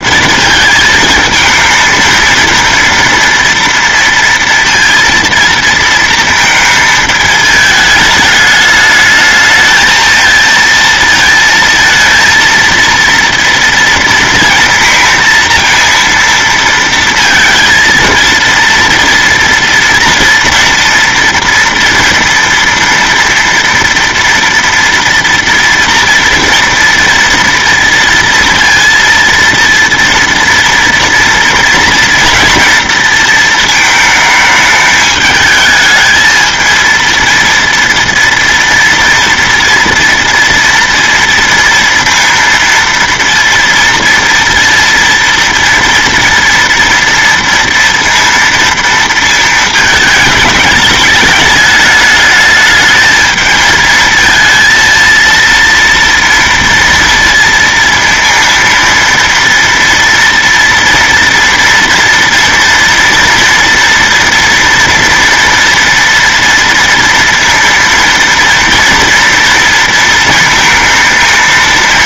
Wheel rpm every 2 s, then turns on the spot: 230, 230, 230, 220, 210, 230, 230, 230, 230, 230, 230, 230, 230, 230, 230, 230, 230, 210, 230, 230, 230, 230, 230, 230, 230, 220, 210, 220, 230, 230, 230, 230, 230, 230, 230, 230.
none